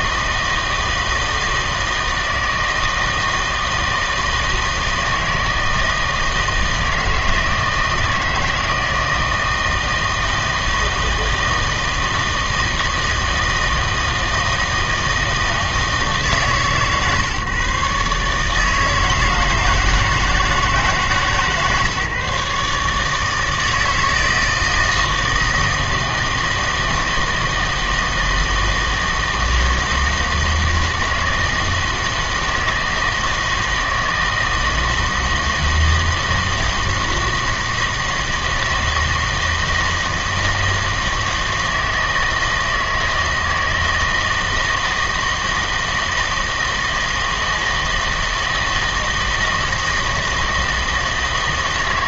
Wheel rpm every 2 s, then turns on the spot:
160, 160, 160, 160, 160, 160, 160, 160, 140, 160, 150, 150, 160, 160, 160, 160, 160, 160, 160, 160, 160, 160, 160, 160, 160, 160.
none